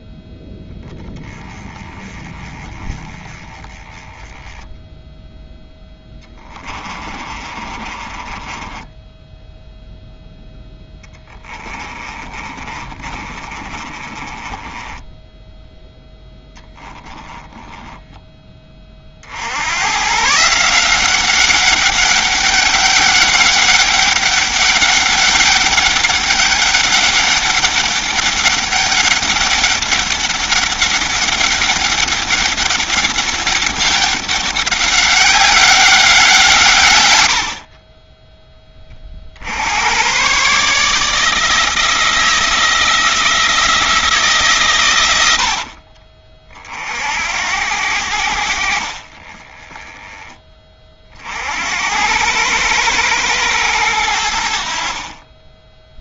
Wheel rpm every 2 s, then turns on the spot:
10, 20, 0, 30, 10, 10, 30, 10, 10, 20, 170, 200, 200, 200, 200, 200, 200, 190, 120, 30, 150, 160, 120, 50, 50, 30, 100, 50.
6-18